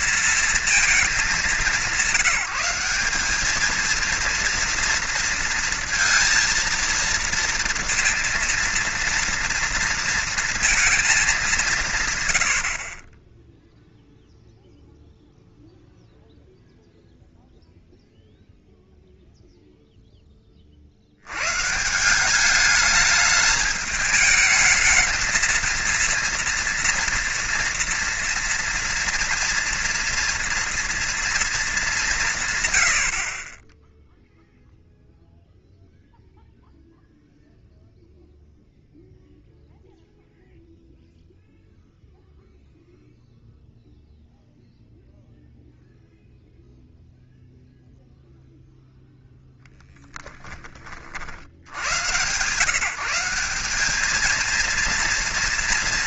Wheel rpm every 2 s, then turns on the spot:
230, 180, 230, 230, 230, 230, 100, 0, 0, 0, 30, 200, 220, 230, 230, 230, 130, 0, 0, 0, 0, 0, 0, 0, 0, 10, 130, 230.
none